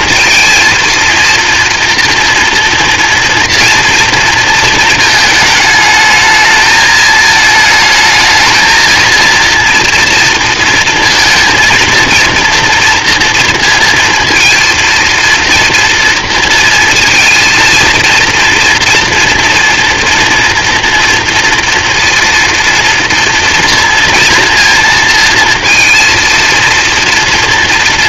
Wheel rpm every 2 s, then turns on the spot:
220, 230, 220, 220, 230, 230, 230, 230, 230, 240, 230, 230, 230, 230.
none